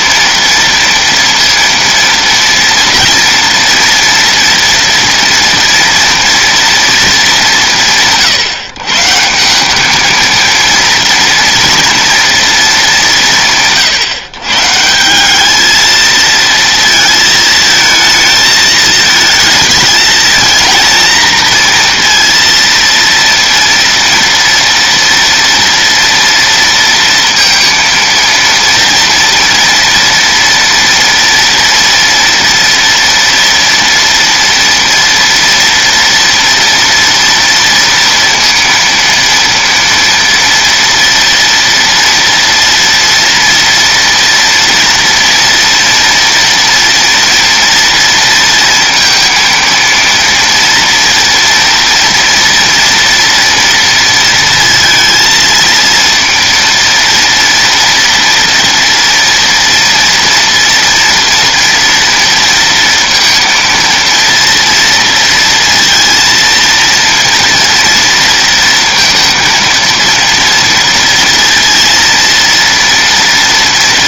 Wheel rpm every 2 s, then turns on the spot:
230, 240, 230, 230, 140, 230, 220, 150, 220, 220, 220, 230, 230, 230, 230, 230, 240, 230, 230, 230, 230, 230, 230, 230, 230, 230, 230, 230, 230, 230, 230, 230, 230, 230, 230, 230, 230.
none